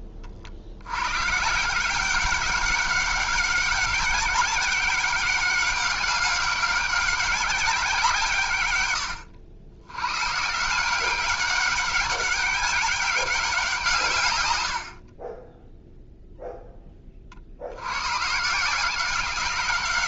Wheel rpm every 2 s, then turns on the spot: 90, 190, 190, 190, 100, 170, 200, 70, 10, 160.
none